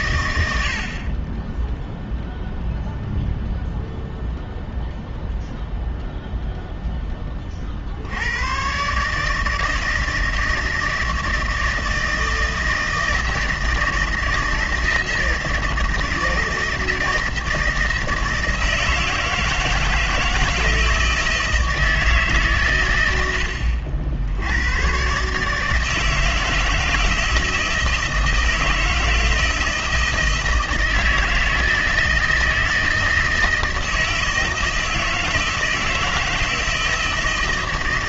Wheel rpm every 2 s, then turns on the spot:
80, 0, 0, 0, 120, 160, 160, 160, 160, 160, 160, 130, 100, 160, 160, 160, 160, 160, 160.
none